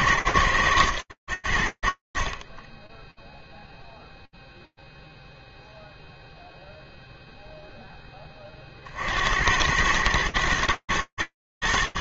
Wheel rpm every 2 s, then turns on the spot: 80, 0, 0, 0, 100, 110.
none